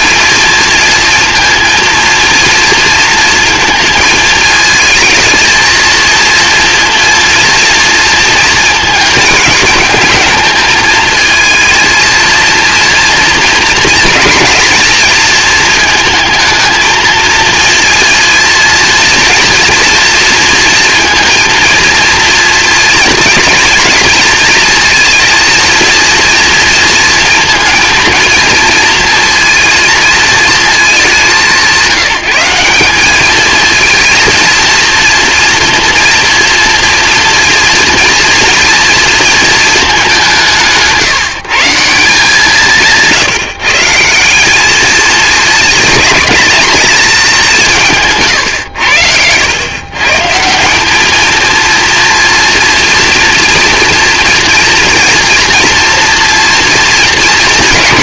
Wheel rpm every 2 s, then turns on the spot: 230, 230, 220, 230, 220, 220, 230, 230, 220, 230, 230, 230, 230, 230, 230, 210, 200, 230, 230, 230, 160, 160, 220, 220, 100, 200, 230, 240, 230.
none